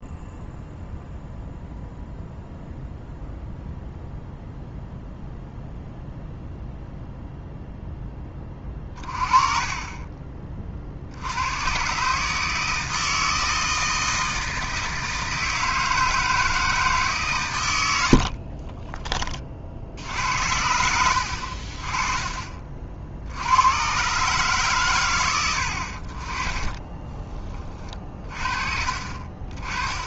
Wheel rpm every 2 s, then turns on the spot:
0, 0, 0, 0, 30, 40, 160, 160, 160, 30, 80, 40, 110, 20, 40.
18-20 26-28